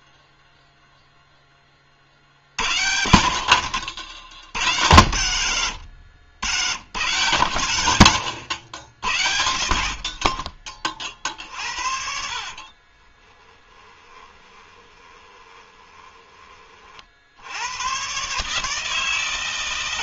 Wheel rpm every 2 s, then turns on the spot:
0, 60, 70, 120, 80, 40, 40, 20, 30, 150.
12-16